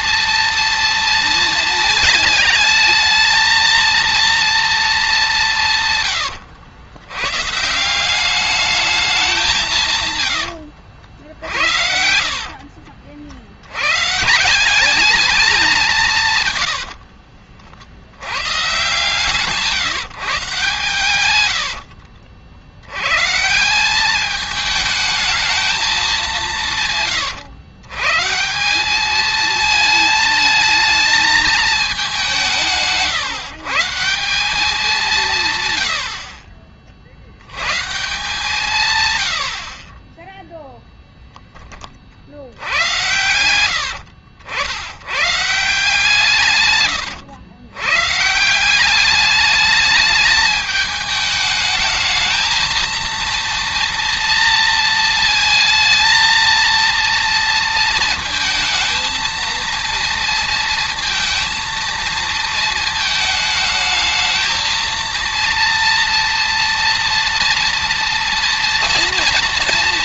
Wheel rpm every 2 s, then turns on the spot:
230, 220, 220, 90, 200, 80, 70, 200, 90, 120, 140, 80, 210, 180, 180, 220, 170, 190, 50, 140, 0, 70, 80, 130, 180, 210, 220, 230, 230, 220, 230, 220, 230, 230, 230.
10-14 16-18